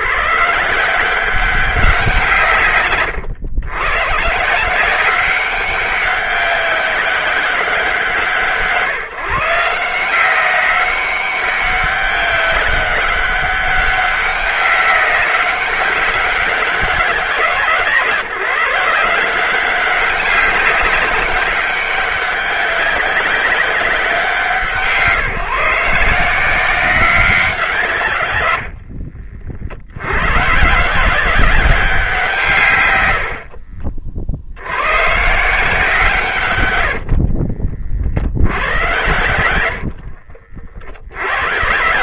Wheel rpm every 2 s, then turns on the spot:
180, 130, 160, 190, 140, 190, 190, 190, 180, 170, 190, 190, 160, 180, 60, 150, 120, 110, 90, 90, 40.
28-30